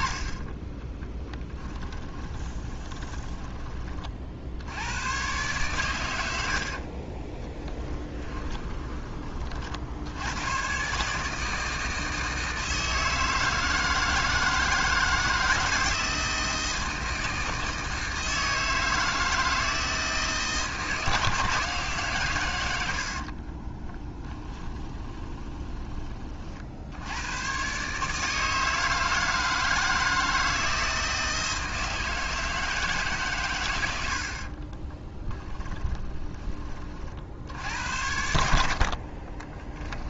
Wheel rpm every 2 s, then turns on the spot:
10, 10, 100, 50, 20, 130, 160, 160, 160, 160, 160, 90, 20, 70, 160, 160, 150, 30, 40, 50.
2-4 6-8 22-26 34-36 38-40